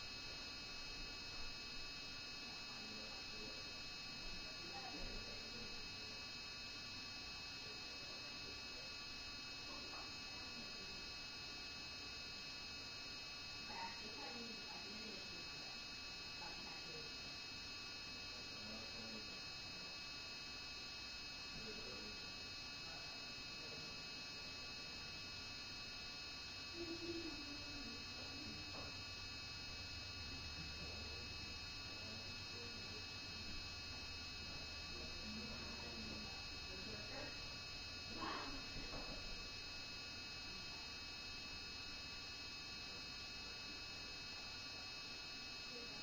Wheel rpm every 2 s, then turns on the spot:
0, 0, 0, 0, 0, 0, 0, 0, 0, 0, 0, 0, 0, 0, 0, 0, 0, 0, 0, 0, 0, 0, 0.
none